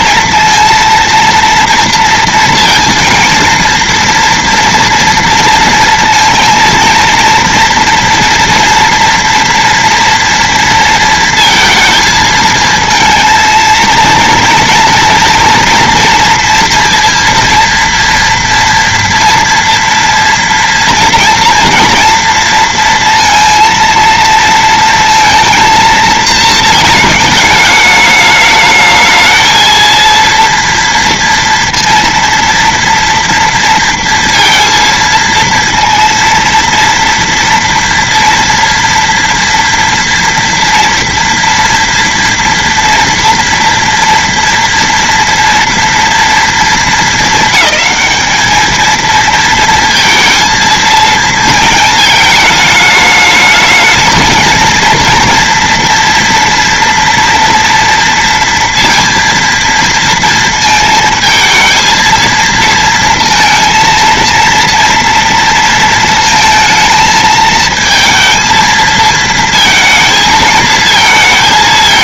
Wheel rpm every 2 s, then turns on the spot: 230, 230, 230, 230, 240, 230, 220, 230, 230, 230, 230, 230, 230, 220, 210, 230, 230, 230, 230, 230, 230, 240, 230, 230, 220, 230, 210, 230, 230, 230, 220, 230, 230, 220, 230, 220.
none